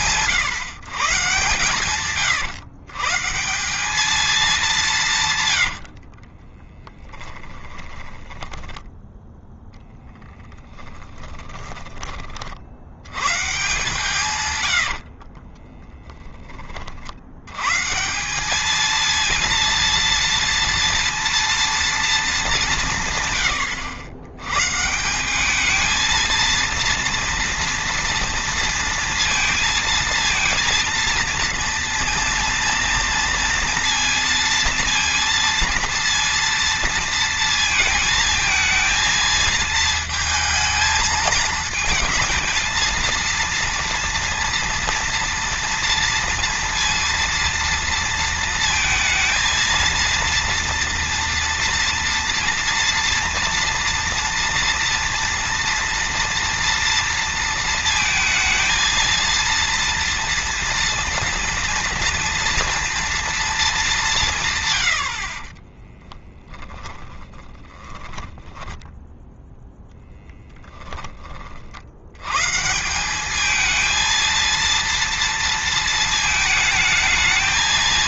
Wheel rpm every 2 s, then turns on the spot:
130, 140, 180, 10, 10, 30, 80, 80, 50, 220, 230, 160, 150, 230, 230, 230, 230, 230, 230, 220, 220, 230, 230, 230, 230, 230, 240, 230, 230, 230, 230, 230, 100, 10, 10, 10, 160, 230, 220.
6-12 14-16 66-68